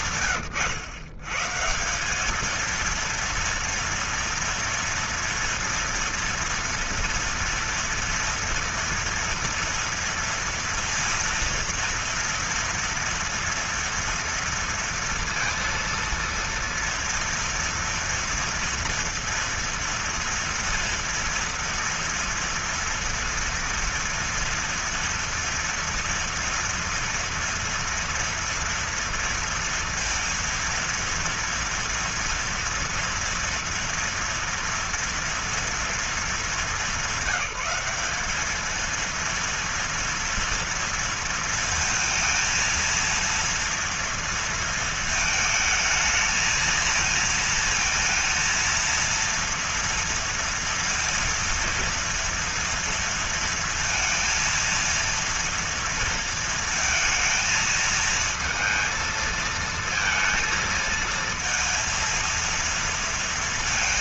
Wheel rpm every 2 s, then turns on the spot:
120, 230, 230, 240, 230, 230, 230, 230, 230, 230, 230, 230, 230, 230, 230, 230, 230, 230, 190, 230, 230, 230, 230, 220, 230, 230, 230, 230, 220, 220, 230, 230.
none